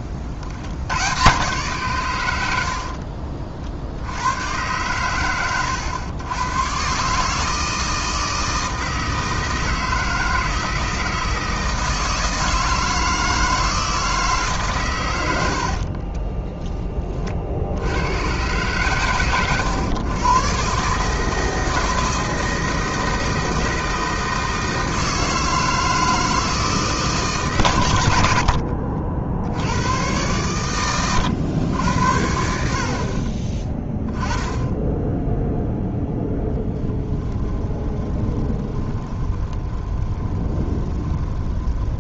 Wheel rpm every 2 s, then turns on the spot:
70, 60, 120, 130, 160, 160, 160, 130, 20, 120, 140, 160, 160, 160, 60, 110, 30, 10, 20, 20, 20.
2-4 28-30 36-42